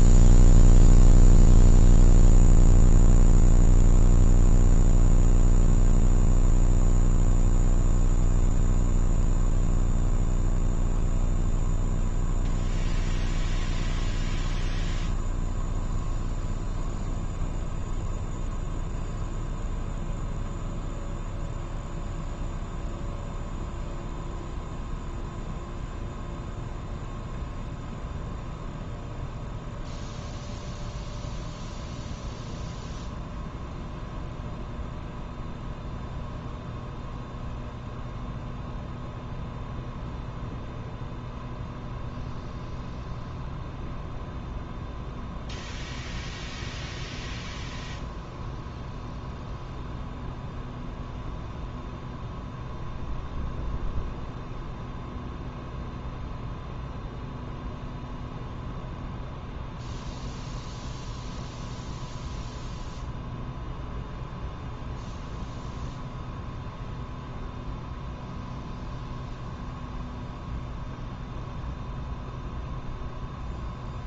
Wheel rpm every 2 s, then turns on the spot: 0, 0, 0, 0, 0, 0, 0, 0, 0, 0, 0, 0, 0, 0, 0, 0, 0, 0, 0, 0, 0, 0, 0, 0, 0, 0, 0, 0, 0, 0, 0, 0, 0, 0, 0, 0, 0.
none